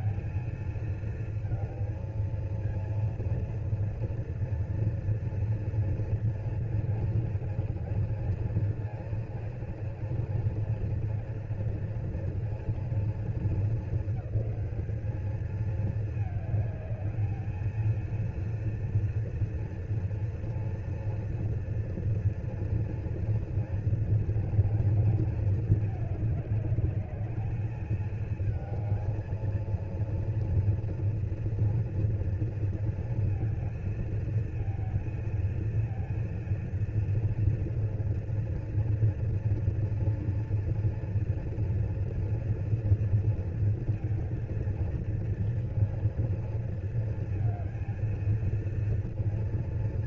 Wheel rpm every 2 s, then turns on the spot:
230, 230, 240, 230, 230, 230, 230, 220, 210, 230, 240, 240, 230, 210, 220, 230, 230, 230, 230, 230, 230, 230, 230, 230, 230.
none